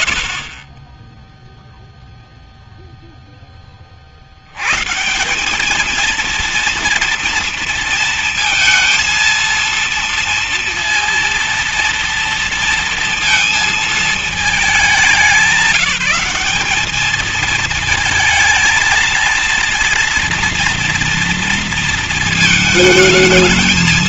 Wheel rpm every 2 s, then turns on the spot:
80, 0, 140, 230, 230, 230, 230, 210, 220, 230, 230, 220.
none